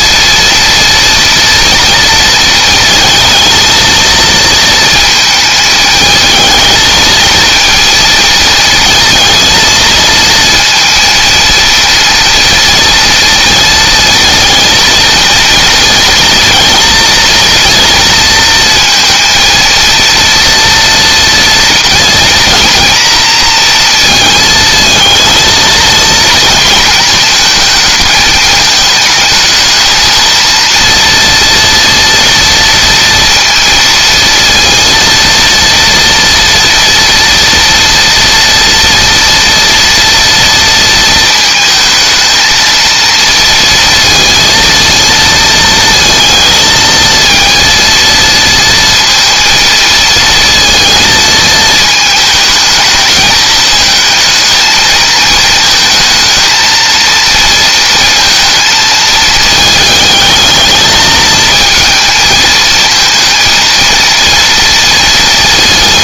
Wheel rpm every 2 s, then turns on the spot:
230, 230, 230, 220, 230, 230, 230, 230, 230, 230, 230, 240, 220, 220, 220, 230, 230, 230, 230, 240, 230, 230, 230, 220, 230, 230, 220, 220, 230, 220, 210, 220, 230.
none